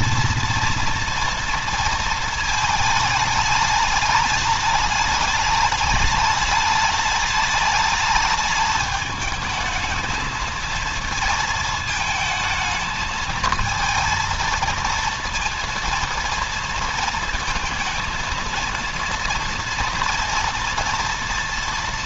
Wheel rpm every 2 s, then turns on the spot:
230, 220, 210, 210, 210, 220, 220, 230, 230, 230, 230.
none